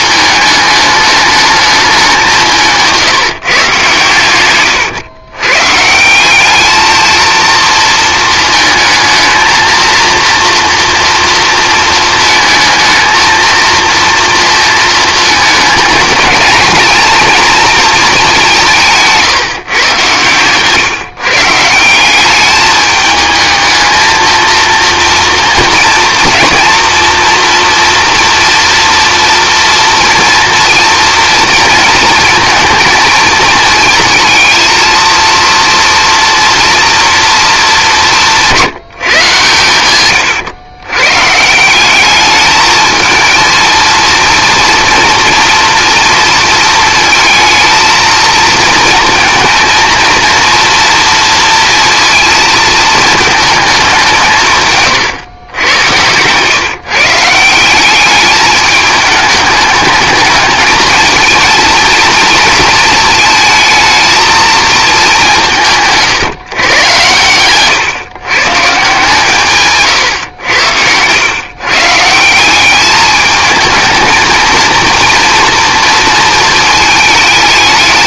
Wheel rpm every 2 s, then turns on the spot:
210, 160, 110, 210, 220, 230, 220, 230, 230, 170, 130, 210, 230, 230, 230, 230, 220, 230, 230, 180, 120, 220, 230, 230, 220, 230, 230, 140, 140, 210, 220, 220, 220, 130, 150, 100, 190, 230, 220.
2-4